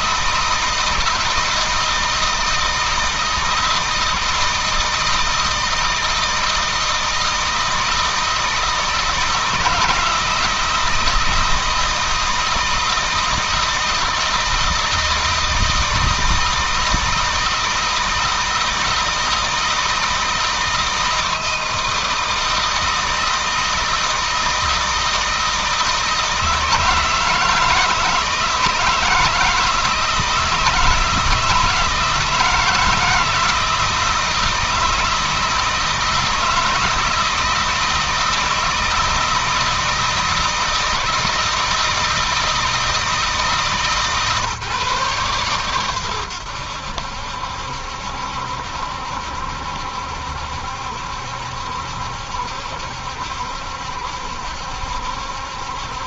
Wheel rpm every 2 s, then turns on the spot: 160, 160, 160, 160, 160, 160, 160, 160, 160, 160, 160, 160, 160, 160, 160, 160, 160, 160, 160, 160, 160, 160, 140, 80, 70, 70, 70, 70.
none